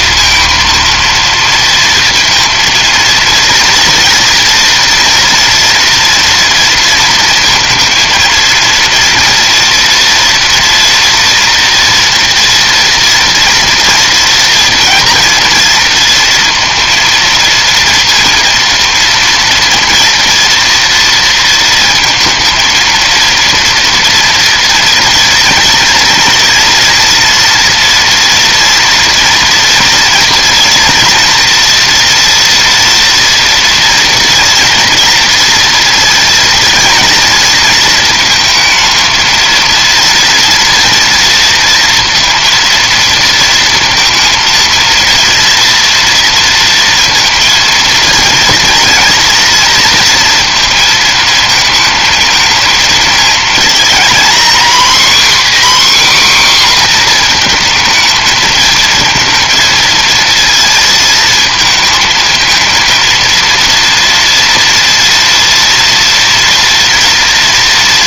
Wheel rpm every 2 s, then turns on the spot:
230, 230, 230, 230, 230, 240, 230, 230, 230, 230, 230, 230, 230, 240, 230, 230, 230, 240, 230, 220, 230, 230, 230, 230, 230, 230, 220, 250, 250, 220, 230, 230, 230, 230.
none